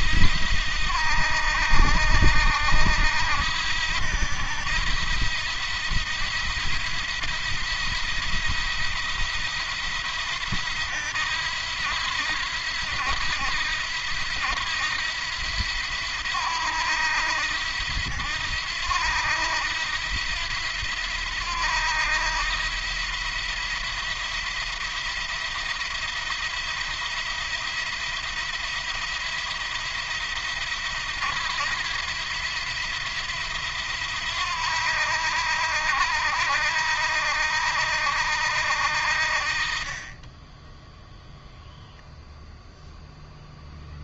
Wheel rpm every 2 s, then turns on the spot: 80, 80, 80, 80, 80, 80, 80, 80, 80, 80, 80, 80, 80, 80, 80, 80, 80, 80, 80, 70, 10, 0.
40-42